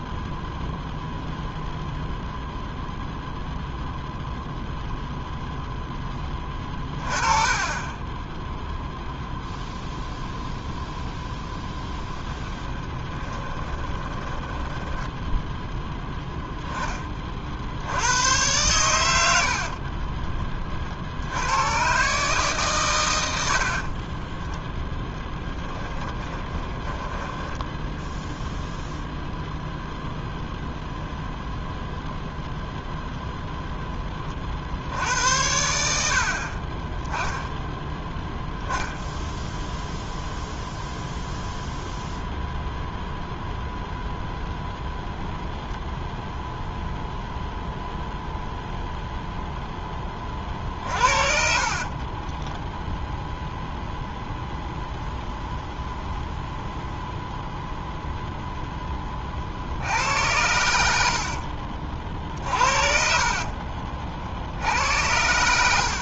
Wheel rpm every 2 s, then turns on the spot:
0, 0, 0, 20, 0, 0, 20, 10, 20, 100, 40, 120, 10, 20, 0, 0, 0, 60, 30, 10, 0, 0, 0, 0, 0, 40, 0, 0, 0, 10, 80, 50, 80.
12-16 24-28 50-52 60-62